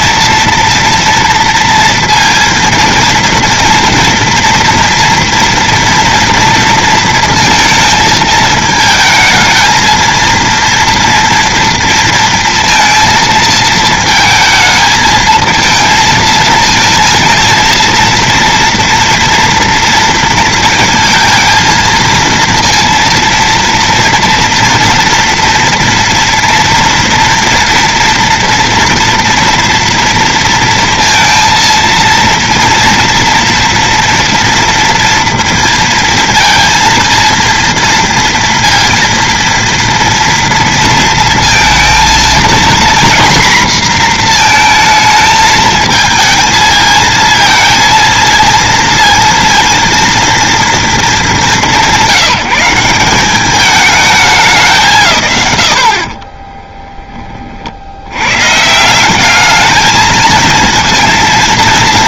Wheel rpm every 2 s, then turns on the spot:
230, 230, 230, 230, 220, 230, 230, 220, 220, 230, 220, 230, 230, 240, 230, 230, 230, 230, 230, 230, 230, 230, 230, 220, 230, 230, 180, 160, 20, 170, 230.
56-58